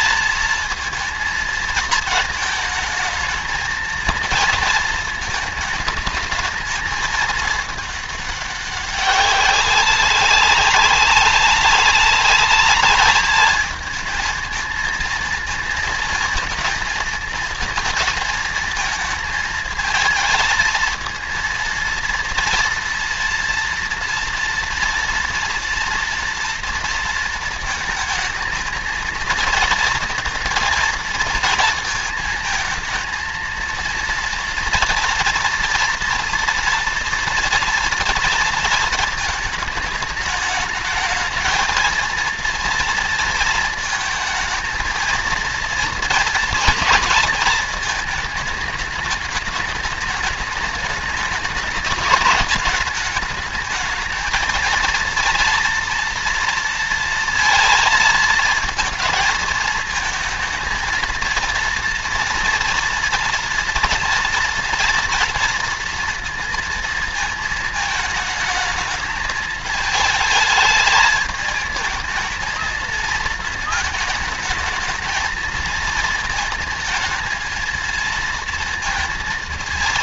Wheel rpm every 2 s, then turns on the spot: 230, 210, 230, 220, 200, 190, 210, 220, 230, 230, 220, 230, 230, 230, 220, 230, 220, 230, 230, 230, 210, 230, 220, 220, 210, 210, 210, 220, 230, 230, 220, 230, 230, 230, 220, 220, 220, 220, 220, 230.
none